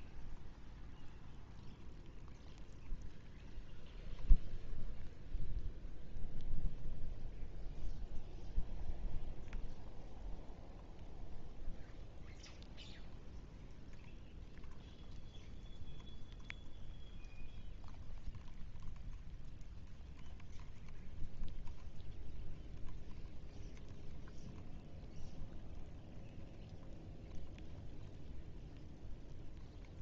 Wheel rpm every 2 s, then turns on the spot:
0, 0, 0, 0, 0, 0, 0, 0, 0, 0, 0, 0, 0, 0, 0.
none